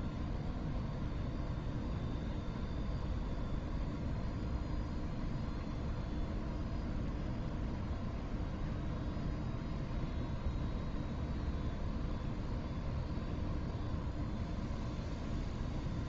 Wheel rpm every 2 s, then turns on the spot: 0, 0, 0, 0, 0, 0, 0, 0.
none